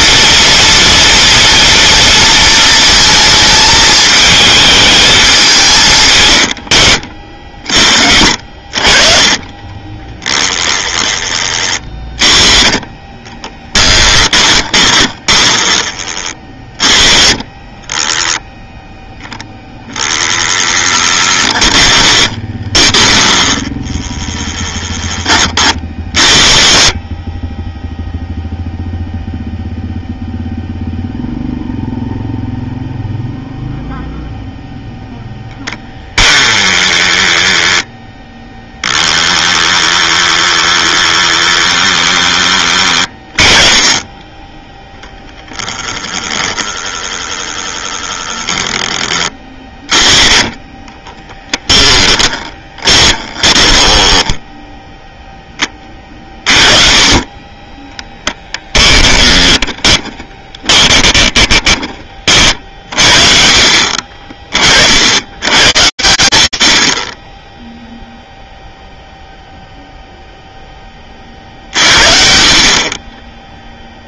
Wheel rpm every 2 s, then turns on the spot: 230, 230, 220, 90, 60, 10, 30, 20, 30, 0, 10, 20, 10, 60, 0, 0, 0, 0, 10, 0, 10, 20, 20, 20, 10, 20, 20, 0, 30, 10, 20, 50, 50, 60, 0, 0, 40.
14-16 20-24 46-48 52-54 58-62